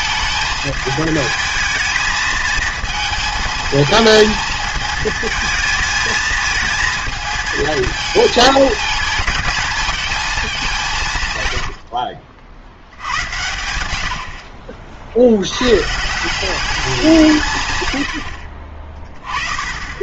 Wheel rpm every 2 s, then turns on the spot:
220, 220, 220, 220, 220, 190, 80, 60, 190, 50.
none